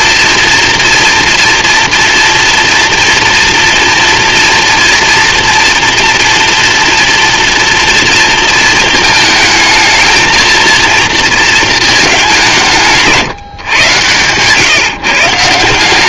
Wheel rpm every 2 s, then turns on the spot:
240, 230, 240, 230, 230, 230, 170, 140.
none